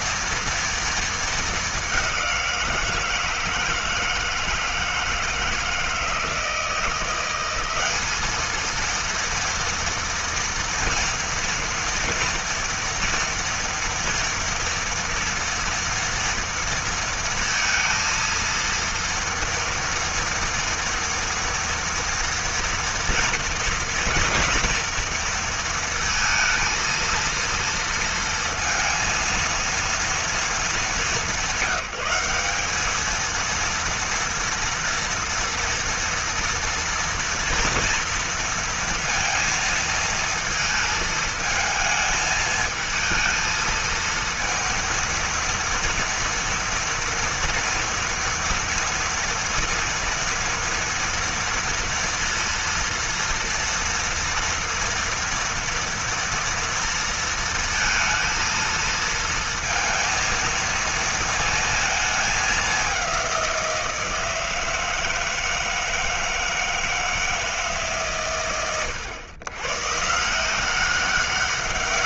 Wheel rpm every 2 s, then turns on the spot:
220, 170, 160, 180, 230, 230, 230, 230, 230, 230, 230, 230, 230, 230, 230, 200, 220, 230, 230, 230, 220, 220, 230, 240, 230, 230, 230, 230, 230, 230, 230, 190, 160, 160, 100, 190.
none